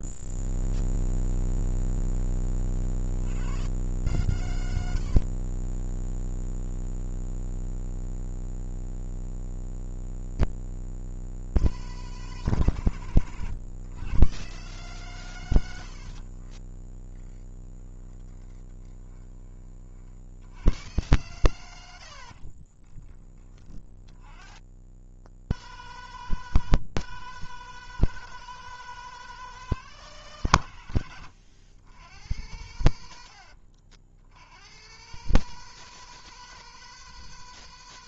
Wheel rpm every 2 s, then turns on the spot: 0, 60, 70, 10, 20, 150, 120, 130, 10, 10, 100, 20, 140, 160, 160, 110, 90, 130, 160.
4-6 16-20 22-24